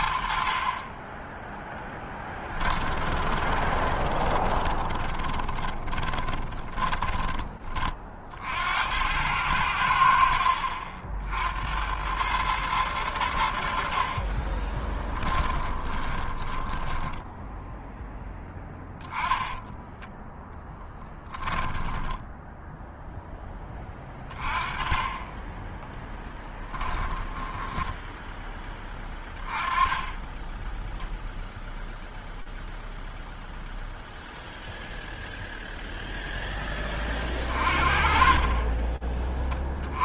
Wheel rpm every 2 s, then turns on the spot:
60, 10, 20, 20, 50, 70, 100, 40, 20, 10, 10, 10, 20, 10, 10, 10, 0, 0, 0, 30.
2-8 14-18 20-24 26-28 38-40